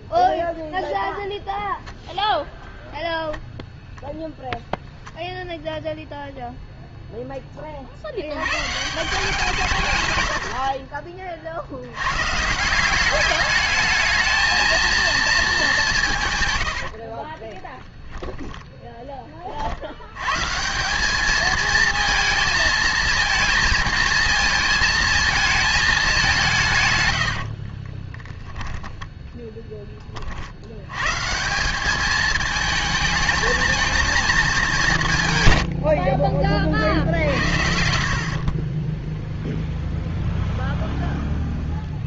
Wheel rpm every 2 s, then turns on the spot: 0, 0, 0, 0, 140, 40, 180, 230, 80, 10, 180, 220, 220, 130, 10, 110, 220, 190, 60, 20, 0.
10-12 16-18